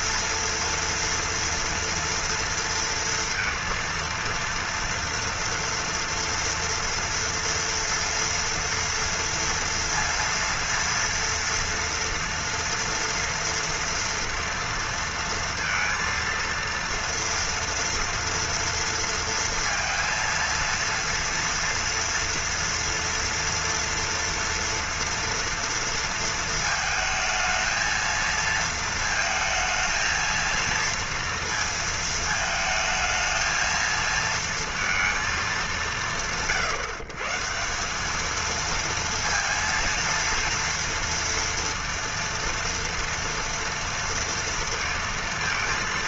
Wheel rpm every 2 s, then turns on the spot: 230, 230, 230, 230, 230, 230, 230, 230, 230, 230, 230, 230, 230, 220, 230, 230, 220, 230, 120, 230, 230, 230, 230.
none